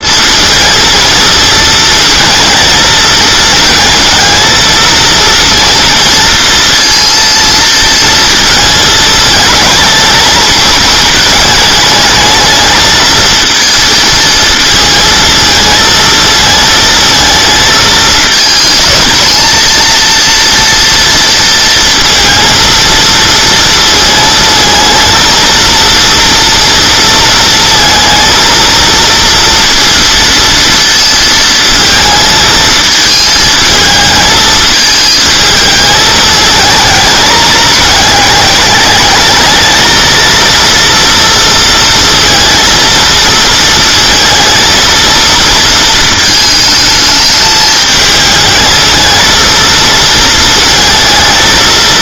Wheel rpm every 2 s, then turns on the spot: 220, 220, 230, 230, 220, 220, 220, 220, 220, 220, 230, 230, 230, 230, 230, 230, 220, 220, 220, 210, 230, 230, 230, 220, 220, 230.
none